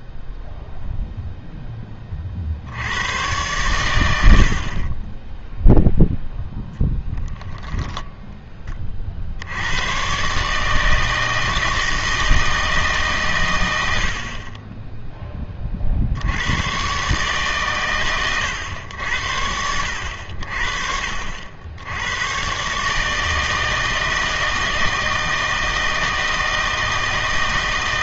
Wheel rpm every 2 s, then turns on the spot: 0, 80, 40, 0, 20, 150, 160, 20, 110, 100, 50, 140, 160, 160.
none